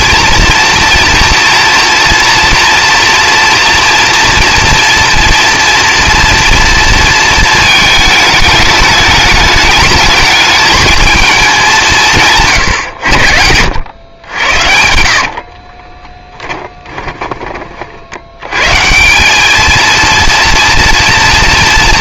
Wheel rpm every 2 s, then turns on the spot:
240, 240, 230, 230, 210, 220, 120, 70, 20, 120, 230.
14-18